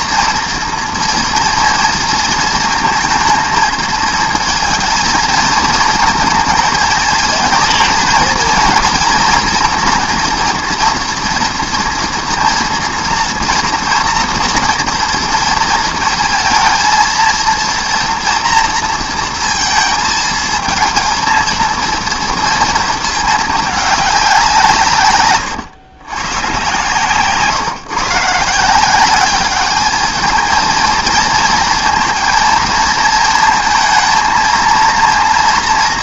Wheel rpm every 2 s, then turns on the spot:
230, 230, 230, 220, 230, 230, 230, 230, 230, 230, 230, 230, 170, 120, 160, 220, 230, 230.
none